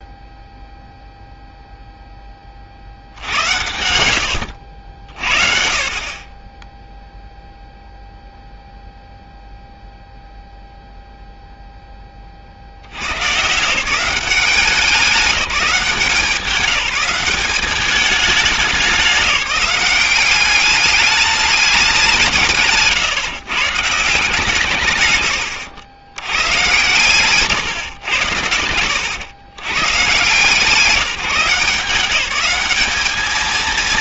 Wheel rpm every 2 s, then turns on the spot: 0, 40, 80, 10, 0, 0, 70, 190, 200, 200, 200, 140, 160, 120, 100, 170, 200.
none